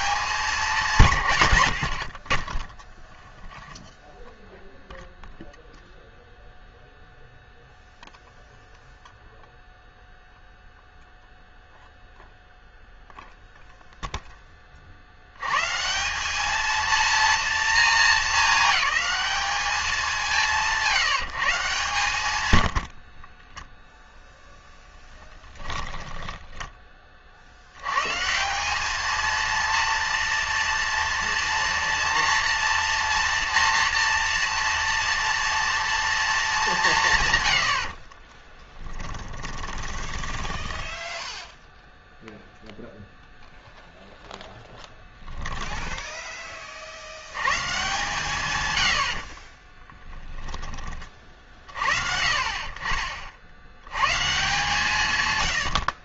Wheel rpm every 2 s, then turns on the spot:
160, 10, 0, 0, 0, 0, 0, 50, 230, 210, 170, 80, 10, 30, 210, 230, 230, 230, 170, 20, 10, 0, 10, 50, 110, 30, 40, 150.
22-26 38-42